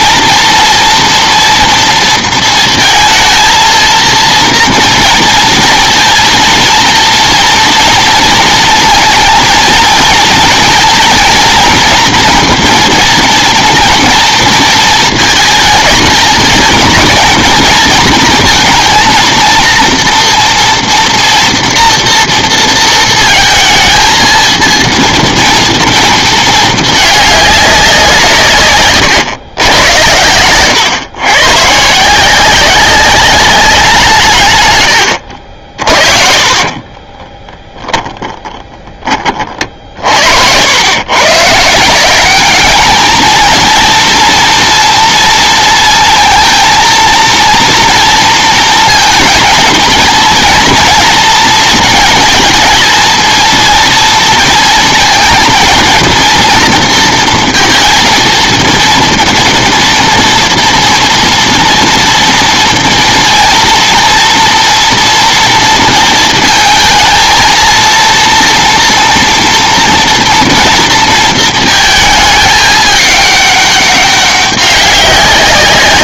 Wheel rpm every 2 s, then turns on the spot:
230, 230, 230, 230, 230, 230, 230, 230, 230, 230, 230, 230, 230, 220, 130, 110, 190, 110, 40, 10, 90, 210, 240, 230, 230, 230, 220, 230, 240, 230, 230, 230, 230, 220, 240, 230, 210, 190.
36-38